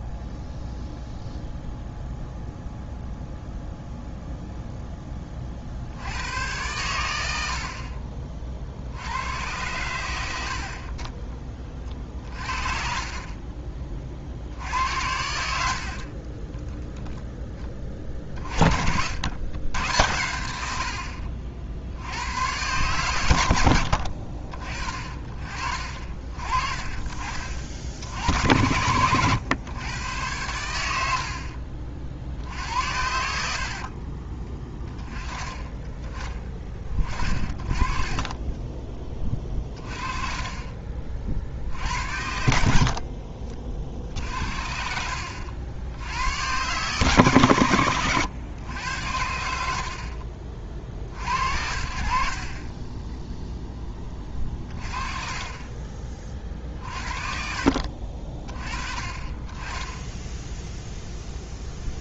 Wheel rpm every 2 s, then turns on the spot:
0, 0, 0, 100, 50, 70, 50, 60, 10, 50, 80, 110, 50, 30, 90, 100, 70, 20, 20, 20, 30, 60, 70, 110, 110, 40, 40, 30, 40, 30, 0.
42-44